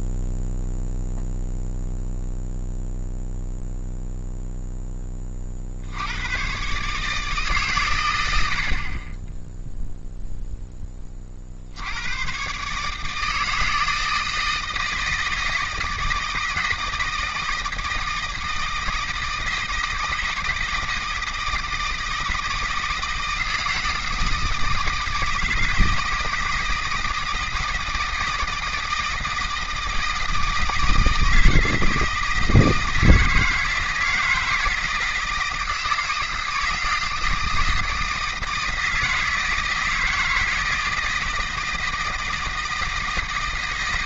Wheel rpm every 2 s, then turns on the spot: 0, 0, 10, 140, 60, 10, 140, 160, 160, 160, 160, 160, 160, 160, 160, 160, 160, 160, 160, 160, 160, 160.
none